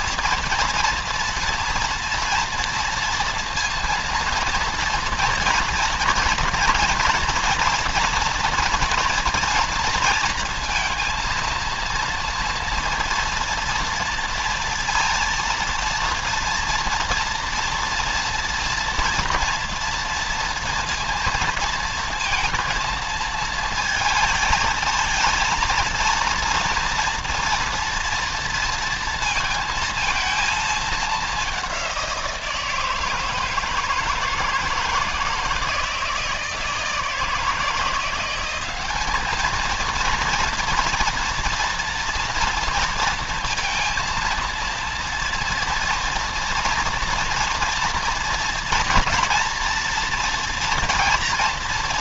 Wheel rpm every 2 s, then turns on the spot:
240, 230, 230, 240, 240, 230, 230, 230, 230, 230, 230, 230, 230, 230, 230, 220, 170, 160, 170, 190, 230, 230, 230, 230, 230, 230.
none